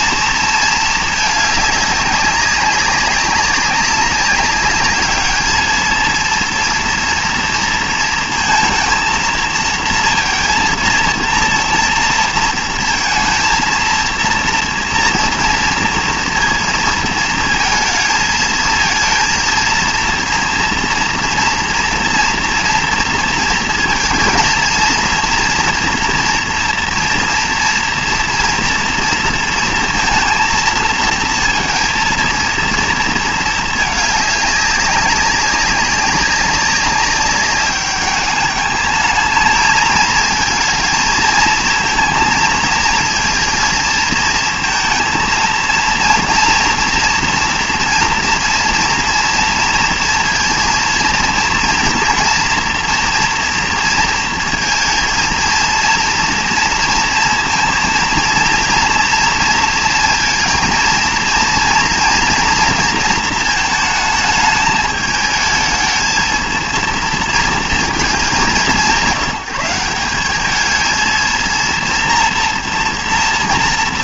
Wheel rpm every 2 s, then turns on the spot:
230, 200, 200, 230, 230, 230, 230, 230, 230, 220, 230, 230, 230, 230, 230, 230, 230, 210, 190, 210, 220, 230, 230, 230, 230, 230, 230, 230, 230, 230, 230, 240, 220, 230, 170, 210, 230.
none